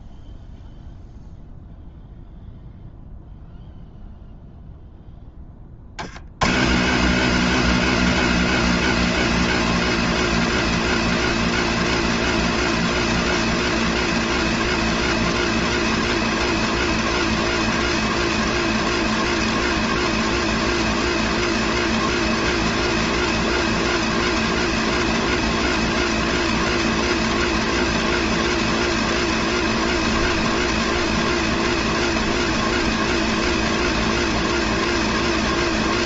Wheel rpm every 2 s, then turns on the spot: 0, 0, 0, 190, 250, 240, 240, 240, 240, 240, 240, 240, 240, 240, 230, 240, 240, 240.
none